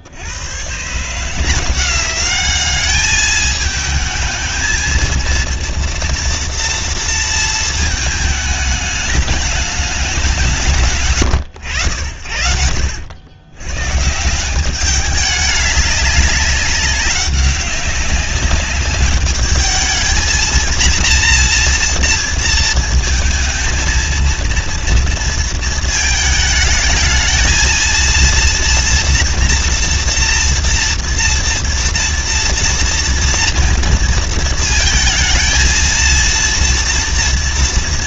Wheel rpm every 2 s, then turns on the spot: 150, 210, 230, 230, 210, 120, 90, 200, 190, 200, 240, 230, 230, 220, 230, 230, 230, 230, 230.
none